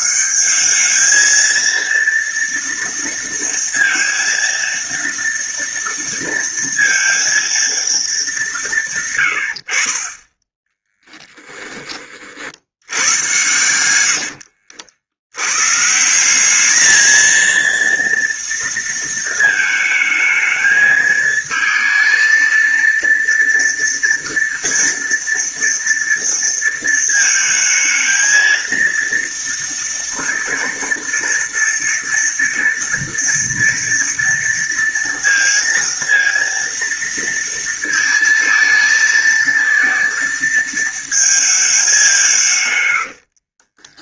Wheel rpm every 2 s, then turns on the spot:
220, 230, 230, 230, 170, 20, 90, 70, 220, 230, 220, 230, 230, 220, 230, 230, 230, 230, 230, 220, 230, 120.
10-12 42-44